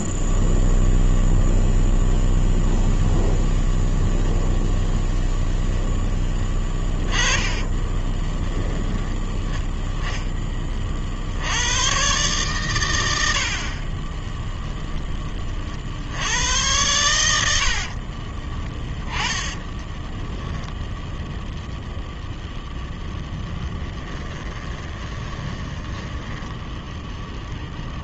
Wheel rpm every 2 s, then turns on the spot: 0, 0, 0, 20, 10, 20, 120, 10, 100, 20, 10, 0, 20, 10.
6-8 18-20 24-28